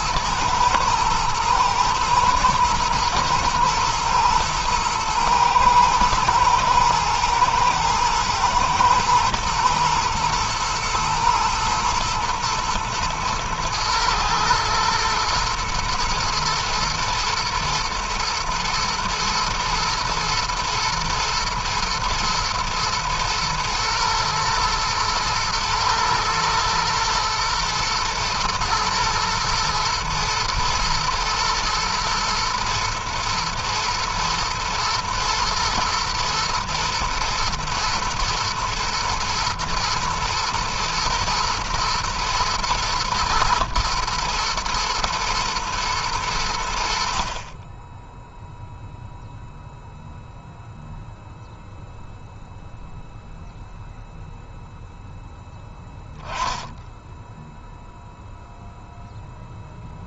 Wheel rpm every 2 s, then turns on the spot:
110, 120, 110, 110, 120, 120, 110, 110, 110, 110, 120, 110, 110, 110, 120, 120, 120, 110, 110, 120, 120, 110, 120, 80, 0, 0, 0, 0, 10, 0.
none